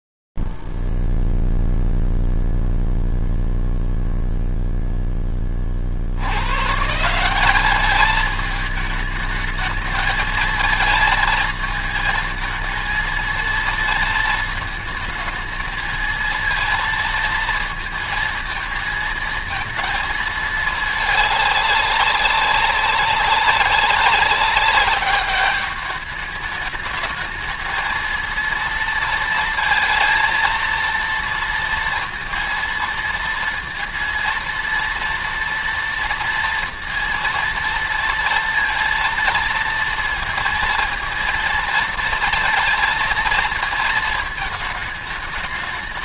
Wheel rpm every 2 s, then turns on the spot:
0, 0, 0, 70, 210, 220, 220, 230, 220, 230, 220, 200, 190, 210, 230, 230, 230, 230, 230, 230, 230, 230, 220.
none